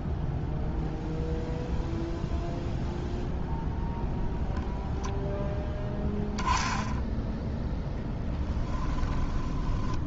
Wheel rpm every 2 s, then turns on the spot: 0, 0, 0, 0, 20.
8-10